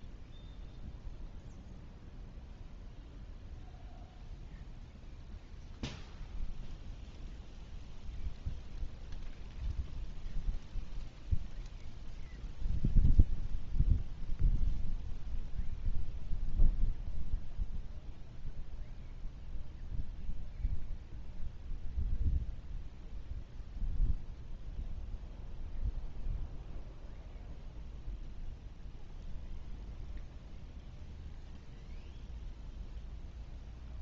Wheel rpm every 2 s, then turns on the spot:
0, 0, 0, 0, 0, 0, 0, 0, 0, 0, 0, 0, 0, 0, 0, 0, 0.
none